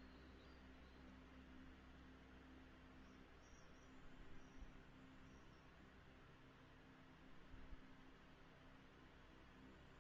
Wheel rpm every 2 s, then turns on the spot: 0, 0, 0, 0, 0.
none